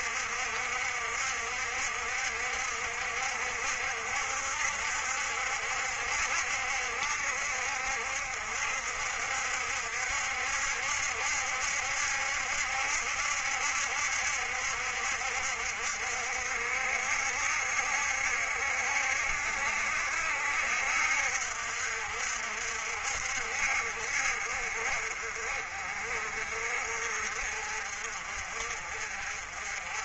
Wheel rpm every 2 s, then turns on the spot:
60, 60, 60, 60, 60, 70, 70, 70, 60, 60, 60, 60, 50, 50, 50.
none